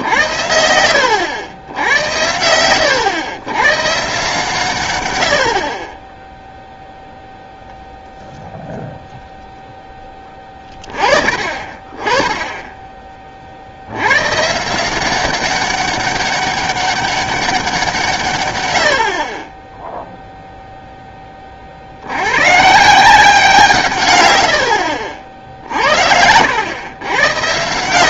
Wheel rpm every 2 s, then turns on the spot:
80, 100, 140, 0, 0, 20, 10, 150, 200, 110, 0, 130, 80, 90.
none